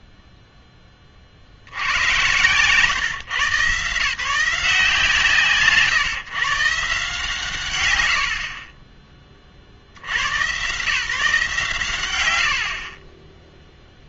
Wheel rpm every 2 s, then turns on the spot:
10, 130, 170, 140, 50, 140, 40.
12-14